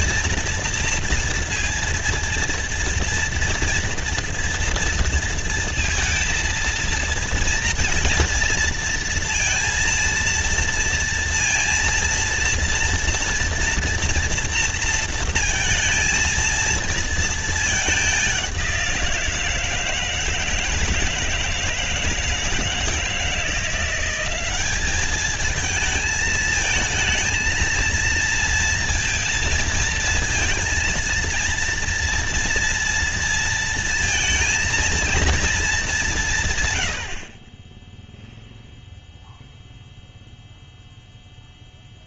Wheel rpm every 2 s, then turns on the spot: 230, 230, 240, 230, 230, 230, 230, 230, 230, 190, 160, 160, 190, 220, 230, 230, 230, 230, 190, 0, 0.
none